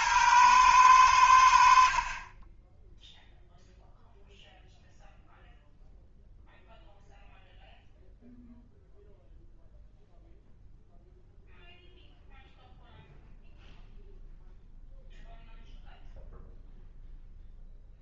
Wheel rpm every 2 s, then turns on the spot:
110, 10, 0, 0, 0, 0, 0, 0, 0.
none